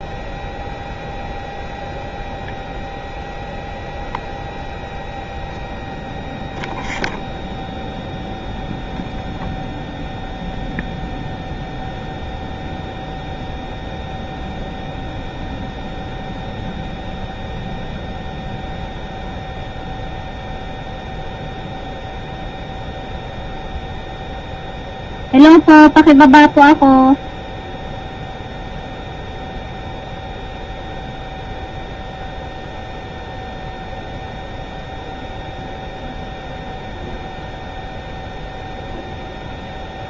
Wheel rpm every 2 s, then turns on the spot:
0, 0, 0, 0, 0, 0, 0, 0, 0, 0, 0, 0, 0, 0, 0, 0, 0, 0, 0, 0.
none